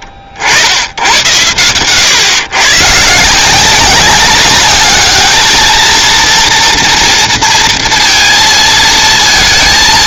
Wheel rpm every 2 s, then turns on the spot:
80, 130, 200, 230, 230.
none